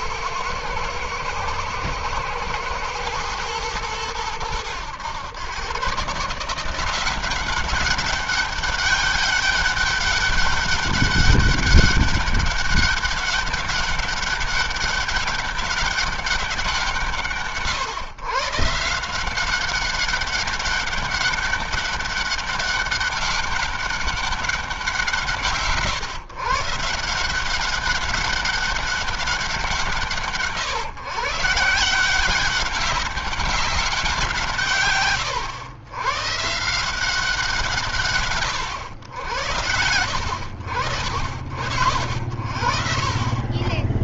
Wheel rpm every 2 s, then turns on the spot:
110, 110, 100, 170, 200, 200, 200, 200, 180, 160, 200, 200, 180, 160, 200, 130, 190, 130, 170, 110, 80, 50.
none